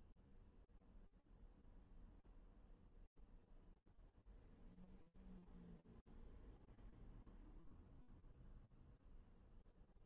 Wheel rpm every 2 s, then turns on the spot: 0, 0, 0, 0, 0.
none